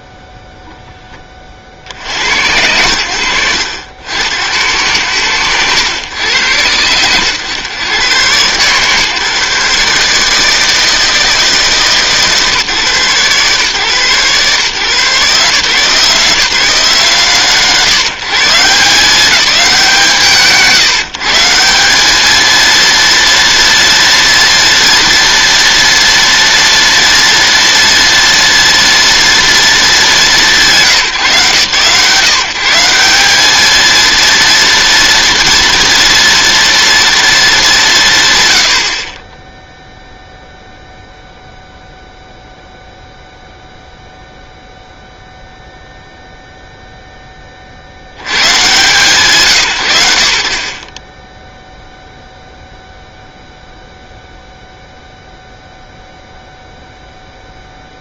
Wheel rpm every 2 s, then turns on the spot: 10, 100, 100, 100, 140, 160, 130, 140, 170, 170, 160, 230, 230, 230, 230, 160, 180, 230, 230, 20, 0, 0, 0, 10, 120, 20, 0, 0, 0.
none